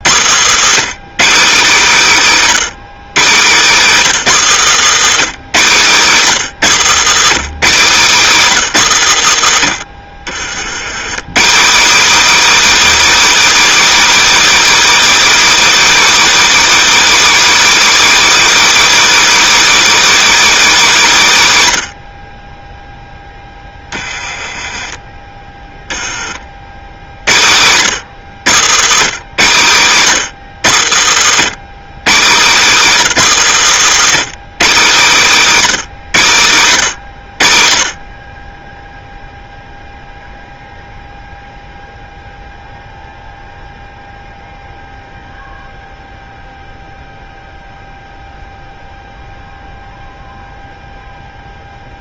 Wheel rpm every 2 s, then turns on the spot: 210, 200, 160, 170, 130, 140, 330, 330, 330, 330, 230, 0, 20, 80, 150, 100, 180, 200, 120, 0, 0, 0, 0, 0, 0, 0.
4-6 30-34